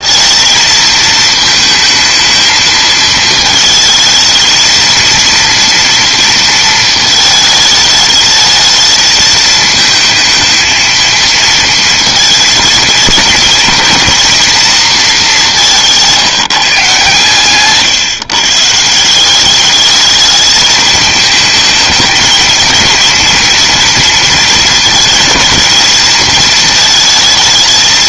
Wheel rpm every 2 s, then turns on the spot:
220, 220, 220, 230, 220, 220, 230, 230, 160, 150, 210, 230, 230, 230.
none